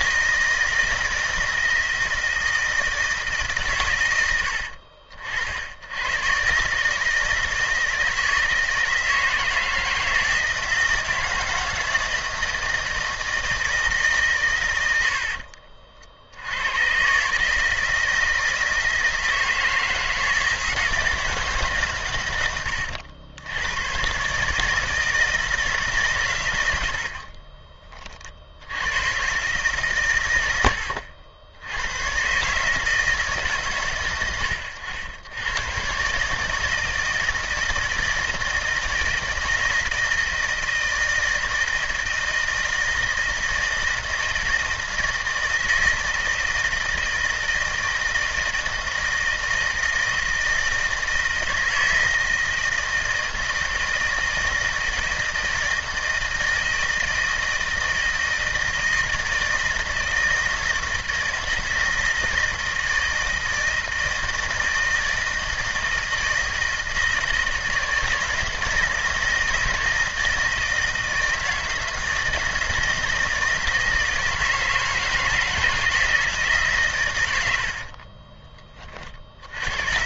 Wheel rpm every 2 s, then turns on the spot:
160, 160, 60, 150, 160, 160, 160, 90, 130, 160, 160, 90, 160, 70, 100, 80, 150, 90, 160, 160, 160, 160, 160, 160, 160, 160, 160, 160, 160, 160, 160, 160, 160, 160, 160, 160, 160, 160, 120, 30.
none